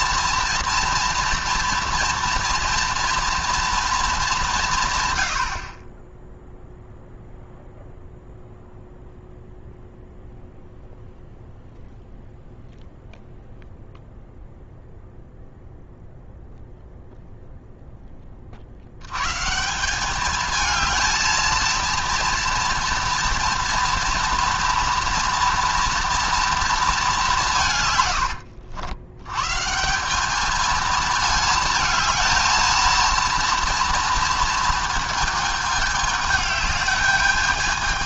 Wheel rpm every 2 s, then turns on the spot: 240, 230, 160, 0, 0, 0, 0, 0, 0, 50, 220, 230, 230, 220, 80, 220, 230, 230, 210.
none